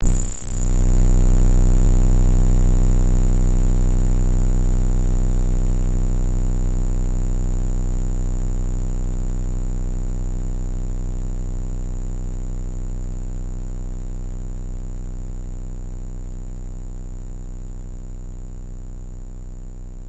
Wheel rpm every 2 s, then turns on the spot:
0, 0, 0, 0, 0, 0, 0, 0, 0, 0.
none